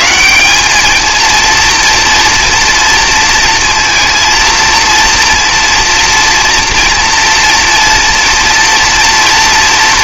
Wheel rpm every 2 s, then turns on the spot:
160, 230, 230, 230, 230.
none